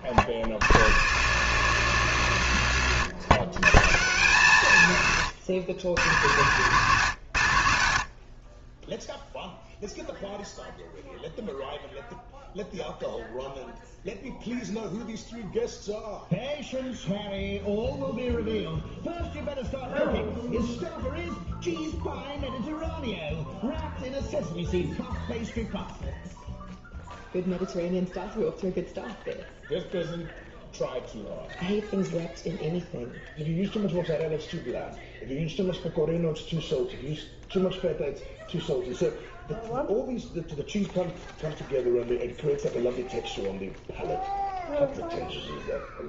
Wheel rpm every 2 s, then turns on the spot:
70, 70, 90, 100, 20, 0, 0, 0, 0, 0, 0, 0, 0, 0, 0, 0, 0, 0, 0, 0, 0, 0, 0.
none